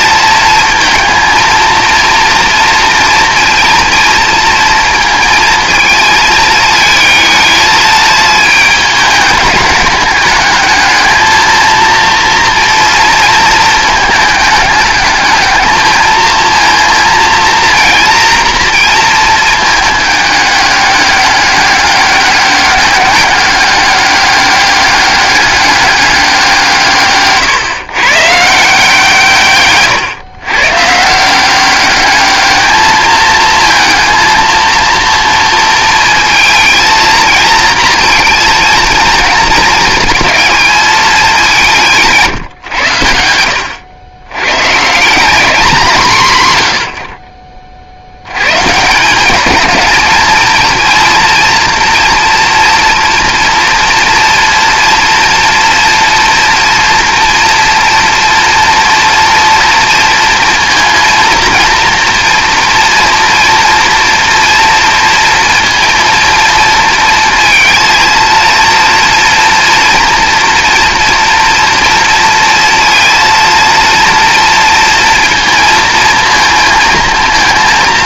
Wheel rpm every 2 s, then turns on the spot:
230, 230, 230, 220, 210, 220, 230, 210, 230, 230, 200, 200, 200, 160, 160, 140, 220, 230, 230, 230, 220, 120, 140, 100, 160, 230, 230, 230, 230, 230, 230, 230, 230, 230, 230, 240, 230, 230, 230.
none